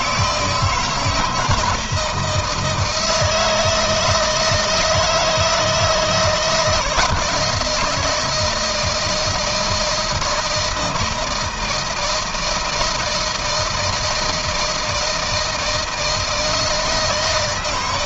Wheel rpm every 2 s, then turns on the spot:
160, 160, 160, 170, 160, 160, 160, 160, 160.
none